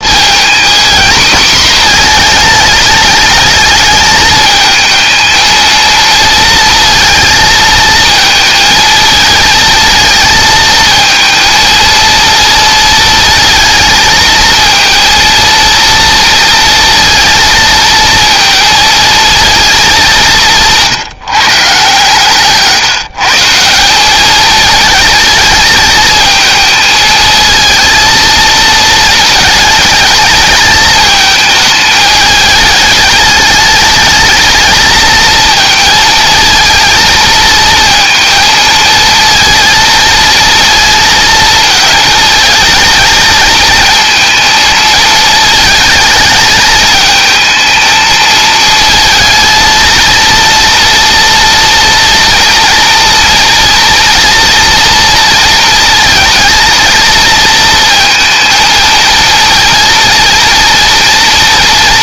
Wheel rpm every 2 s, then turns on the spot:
230, 220, 220, 230, 220, 230, 230, 230, 230, 230, 170, 150, 220, 220, 220, 220, 210, 220, 220, 220, 220, 220, 230, 220, 220, 230, 230, 230, 230, 230, 230.
none